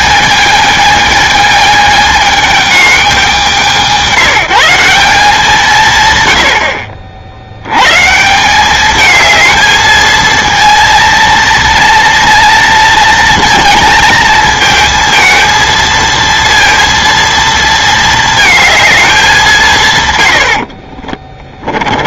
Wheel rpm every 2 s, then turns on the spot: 220, 210, 190, 60, 190, 230, 230, 220, 230, 230, 50.
20-22